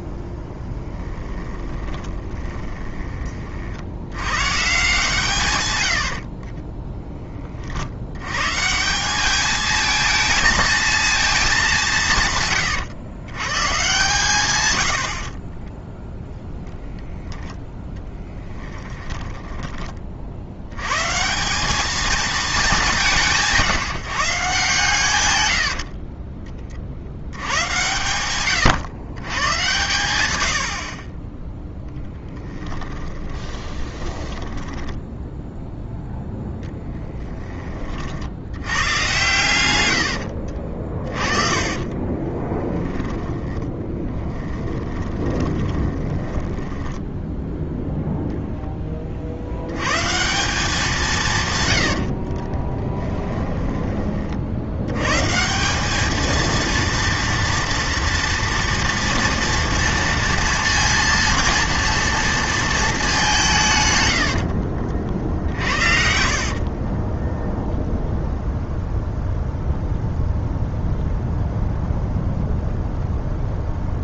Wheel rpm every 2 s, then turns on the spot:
20, 20, 150, 10, 160, 230, 120, 90, 0, 10, 110, 200, 140, 40, 120, 60, 20, 10, 10, 110, 50, 10, 20, 10, 20, 180, 20, 80, 230, 230, 230, 220, 50, 40, 0, 0, 0.
0-4 6-8 12-14 18-20 30-38 40-48 52-54 64-68